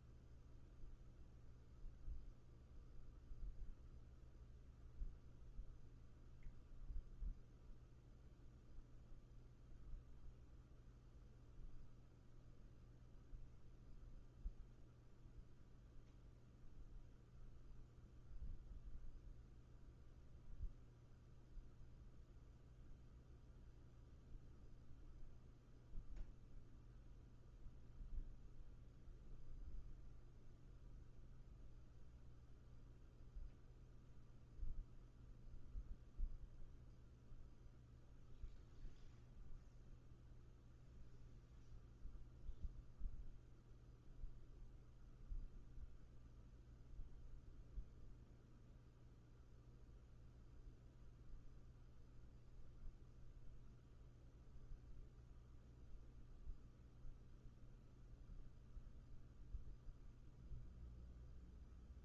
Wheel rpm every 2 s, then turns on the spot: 0, 0, 0, 0, 0, 0, 0, 0, 0, 0, 0, 0, 0, 0, 0, 0, 0, 0, 0, 0, 0, 0, 0, 0, 0, 0, 0, 0, 0, 0, 0.
none